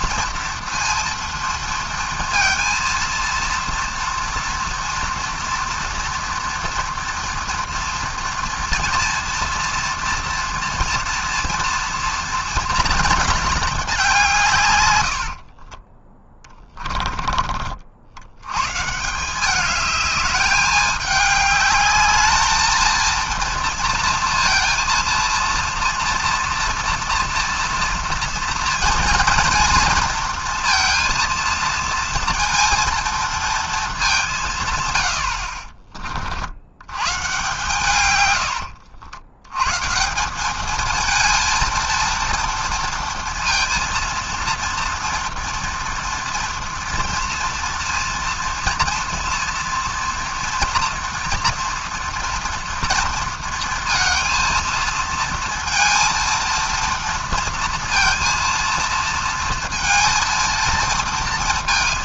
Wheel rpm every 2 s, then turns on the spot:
230, 230, 230, 230, 230, 230, 230, 160, 20, 120, 210, 220, 230, 230, 230, 230, 230, 170, 60, 90, 210, 230, 230, 230, 230, 230, 230, 230, 230, 230, 230.
none